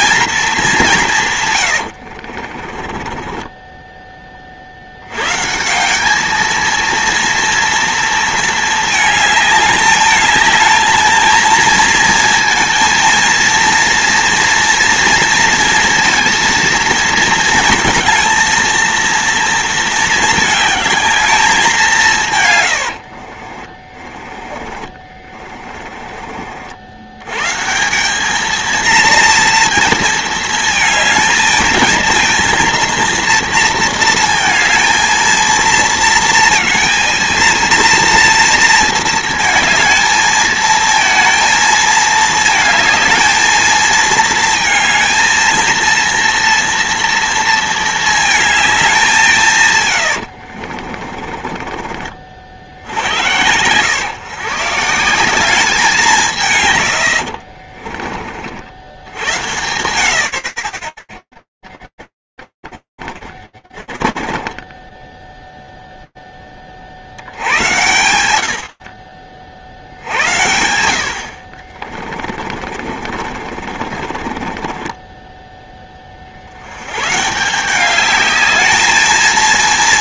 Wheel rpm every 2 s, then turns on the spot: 210, 100, 20, 170, 230, 210, 220, 230, 230, 220, 220, 210, 40, 30, 160, 230, 220, 230, 220, 230, 220, 230, 220, 230, 220, 140, 40, 110, 190, 50, 90, 30, 10, 110, 70, 40, 40, 20, 180, 230.
2-6 24-28 50-52 58-60 62-64 70-74